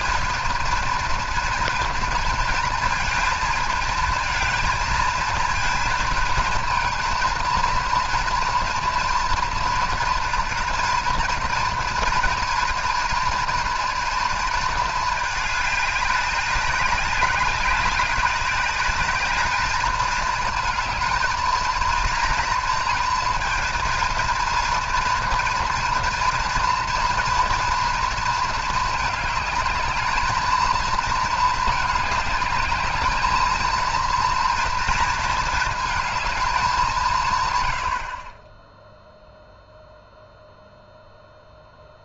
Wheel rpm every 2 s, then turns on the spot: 230, 230, 220, 230, 230, 230, 230, 220, 200, 210, 220, 230, 230, 230, 220, 230, 210, 230, 180, 0, 0.
none